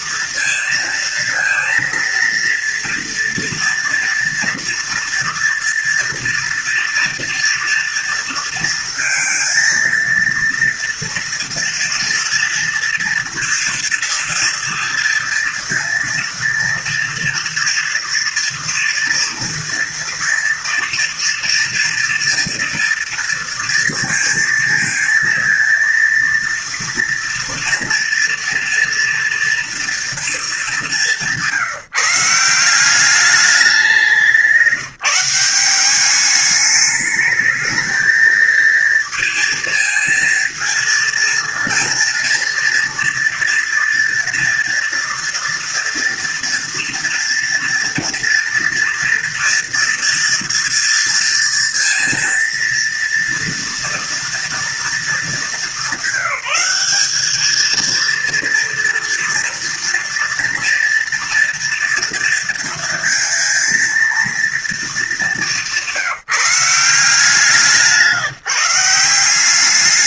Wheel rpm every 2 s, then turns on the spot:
230, 230, 230, 230, 230, 230, 230, 230, 230, 230, 230, 230, 220, 230, 230, 190, 190, 170, 210, 220, 230, 240, 230, 240, 230, 230, 230, 220, 200, 230, 230, 230, 220, 170, 180.
none